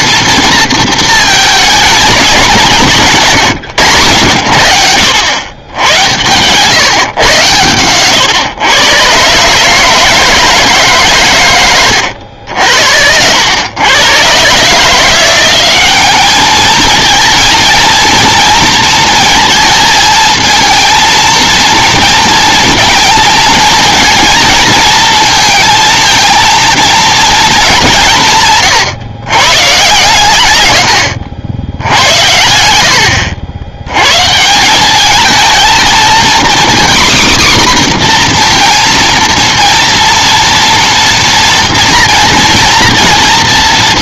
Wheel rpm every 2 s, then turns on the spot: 230, 190, 90, 130, 120, 160, 80, 140, 210, 220, 230, 230, 230, 230, 150, 100, 80, 180, 250, 240, 230, 230.
none